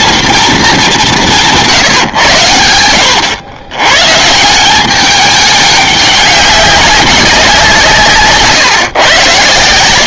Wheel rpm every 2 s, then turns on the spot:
210, 90, 190, 200, 130.
none